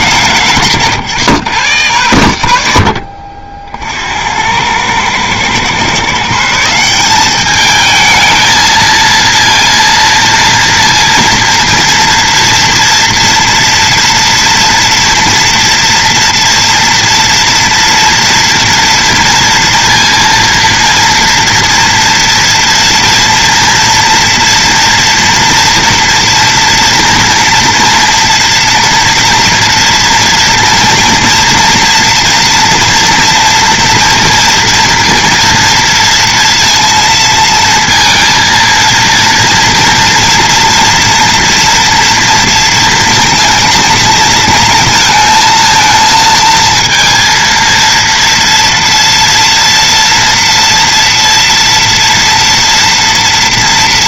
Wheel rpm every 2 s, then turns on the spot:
140, 90, 80, 150, 220, 230, 240, 230, 230, 230, 230, 230, 230, 230, 230, 230, 240, 240, 230, 230, 230, 230, 230, 230, 230, 240, 230.
none